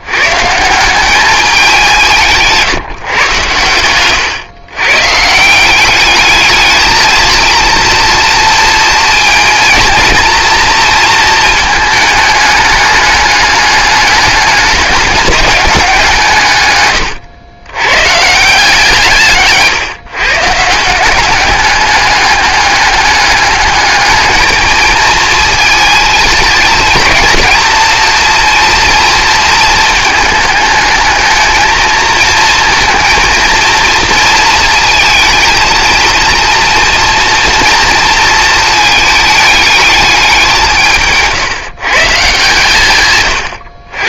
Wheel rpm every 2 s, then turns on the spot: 160, 170, 120, 210, 230, 230, 210, 200, 140, 160, 150, 200, 220, 220, 230, 220, 230, 230, 230, 230, 180, 150.
none